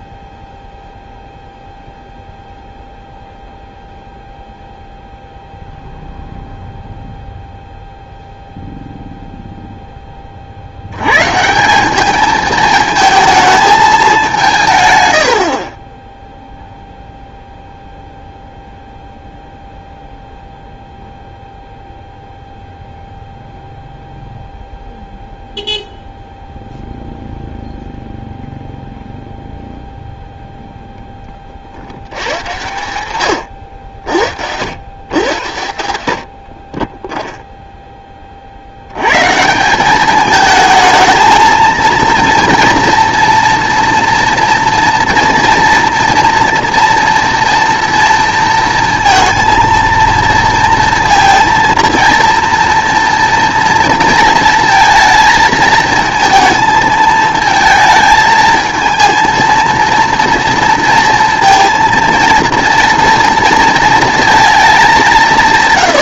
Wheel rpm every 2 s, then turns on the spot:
0, 0, 0, 0, 0, 70, 220, 150, 0, 0, 0, 0, 0, 0, 0, 0, 120, 90, 30, 70, 220, 230, 240, 230, 230, 230, 230, 230, 220, 220, 230, 230, 210.
none